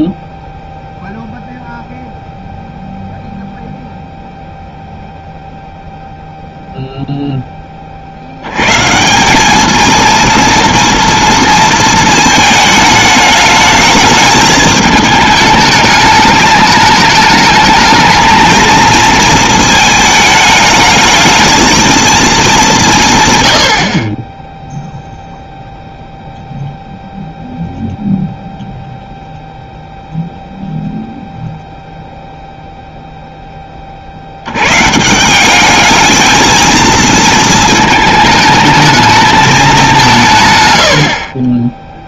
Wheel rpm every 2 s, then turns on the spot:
0, 0, 0, 0, 170, 230, 210, 210, 210, 230, 220, 140, 0, 0, 0, 0, 0, 90, 220, 220, 200.
none